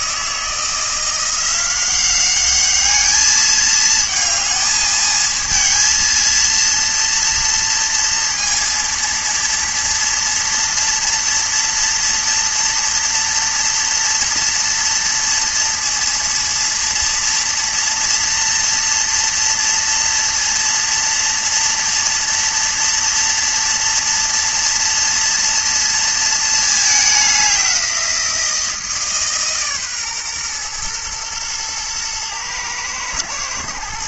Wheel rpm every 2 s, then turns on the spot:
160, 200, 220, 230, 230, 230, 230, 230, 230, 230, 230, 230, 230, 220, 170, 120, 110.
none